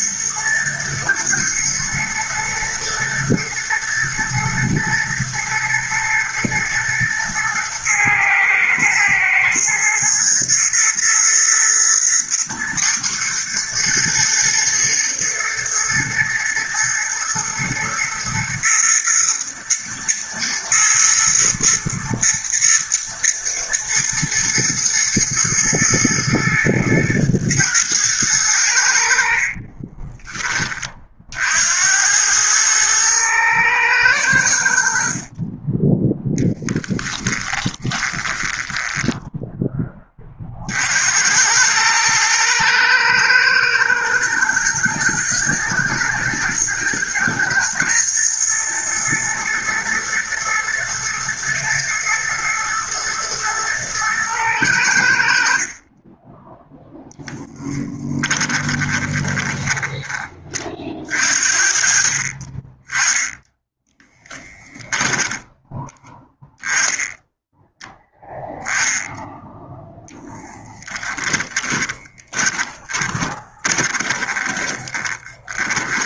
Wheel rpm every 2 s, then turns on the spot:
110, 120, 120, 110, 120, 120, 110, 120, 120, 120, 110, 110, 110, 120, 70, 50, 110, 50, 10, 10, 70, 110, 110, 110, 120, 110, 120, 80, 10, 20, 40, 10, 10, 10, 0, 20, 20, 20.
28-30 36-40 58-60 70-76